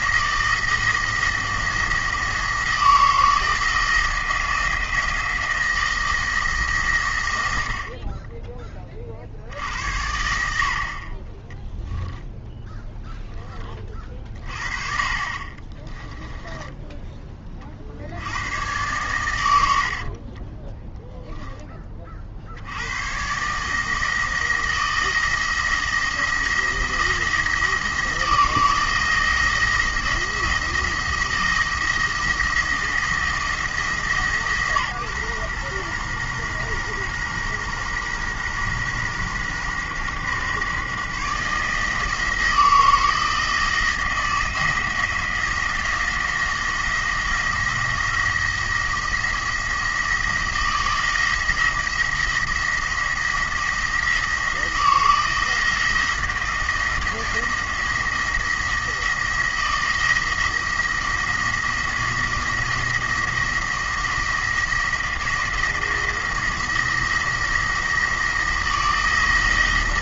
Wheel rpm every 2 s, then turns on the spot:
170, 170, 170, 150, 20, 60, 0, 30, 10, 110, 10, 80, 170, 170, 170, 170, 170, 140, 120, 130, 140, 160, 170, 160, 170, 170, 170, 170, 170, 170, 170, 170, 170, 170, 170.
16-18 20-22